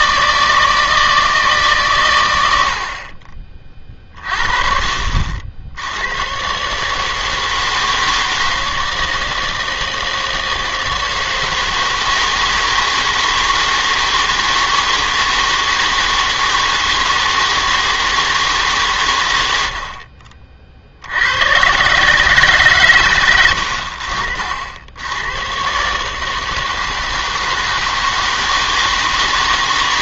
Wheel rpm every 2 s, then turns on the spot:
160, 80, 40, 140, 160, 160, 160, 160, 160, 150, 50, 130, 60, 160, 160.
none